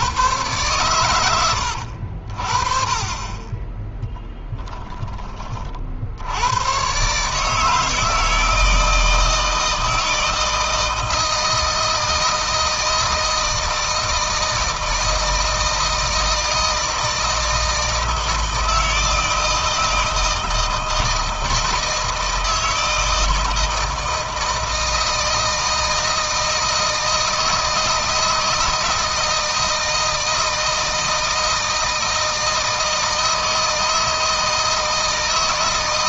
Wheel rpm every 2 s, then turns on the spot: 120, 40, 10, 120, 160, 160, 160, 170, 160, 160, 160, 160, 160, 160, 160, 160, 160, 160.
none